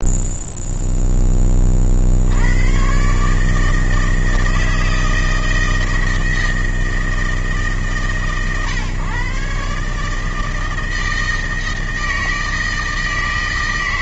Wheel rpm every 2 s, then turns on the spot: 0, 130, 160, 160, 130, 160, 160.
none